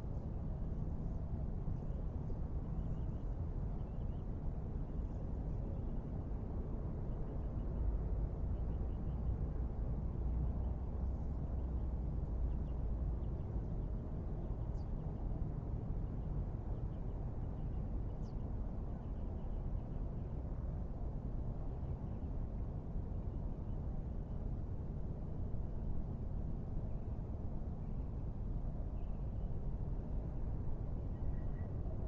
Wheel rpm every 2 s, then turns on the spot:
0, 0, 0, 0, 0, 0, 0, 0, 0, 0, 0, 0, 0, 0, 0, 0.
none